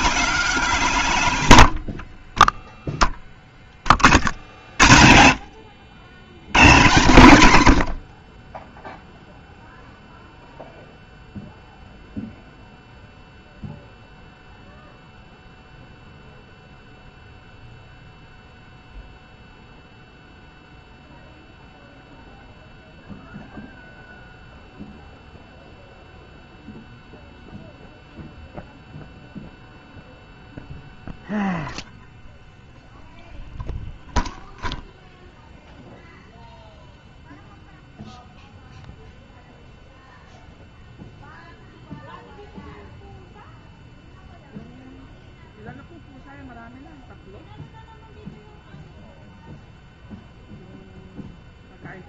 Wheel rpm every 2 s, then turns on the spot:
10, 60, 130, 10, 0, 0, 0, 0, 0, 0, 0, 0, 0, 0, 0, 0, 0, 0, 0, 0, 0, 0, 0, 0, 0, 0.
none